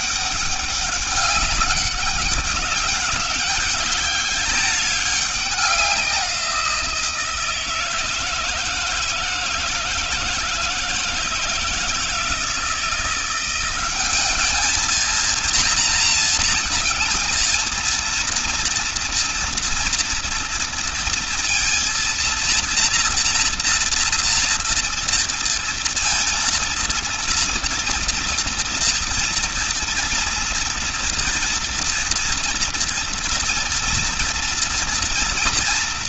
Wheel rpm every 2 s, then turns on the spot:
200, 200, 200, 170, 160, 160, 170, 230, 230, 230, 230, 230, 230, 230, 230, 230, 230, 230.
none